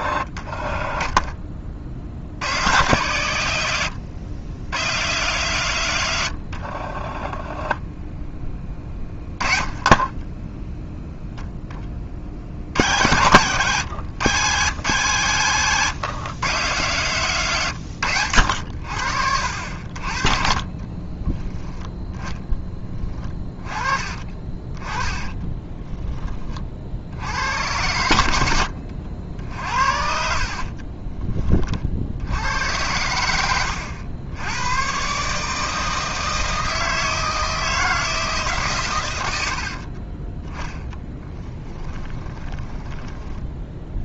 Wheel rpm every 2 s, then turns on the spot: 20, 100, 110, 40, 10, 10, 80, 140, 130, 80, 30, 20, 20, 40, 70, 40, 90, 110, 160, 140, 10, 20.
8-12 20-26 28-32 42-44